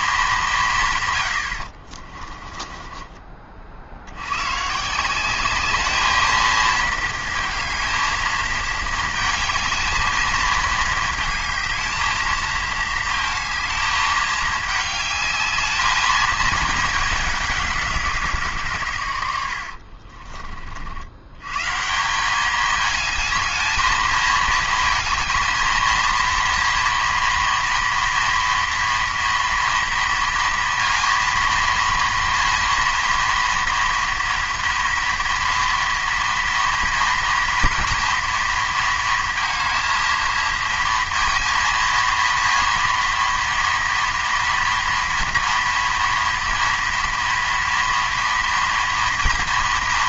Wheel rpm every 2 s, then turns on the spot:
180, 30, 120, 220, 220, 220, 220, 210, 220, 150, 50, 200, 220, 230, 230, 230, 230, 230, 230, 230, 230, 230, 230, 230, 230.
2-4